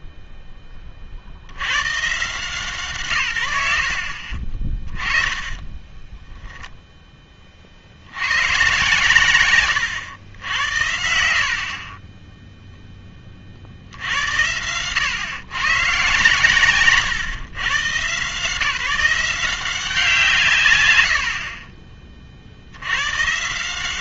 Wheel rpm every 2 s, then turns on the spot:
10, 160, 40, 0, 120, 70, 0, 90, 140, 150, 140, 70.
4-6